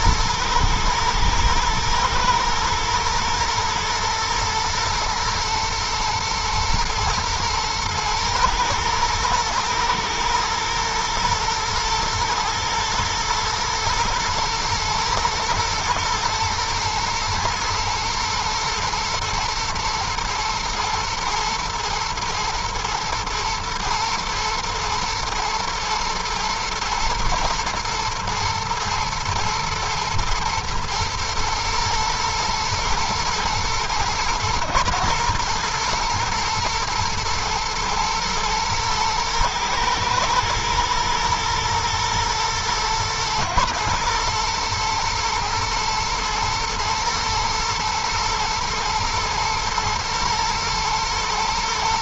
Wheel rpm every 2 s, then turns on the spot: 110, 110, 110, 120, 110, 110, 110, 110, 120, 120, 110, 120, 120, 120, 110, 120, 110, 120, 110, 110, 120, 120, 110, 120, 120, 120.
none